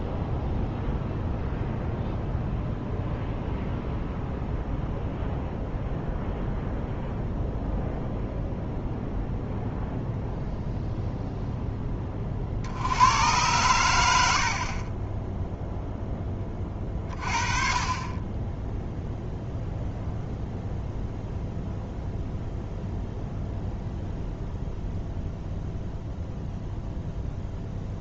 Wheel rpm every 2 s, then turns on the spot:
0, 0, 0, 0, 0, 0, 60, 50, 30, 0, 0, 0, 0, 0.
none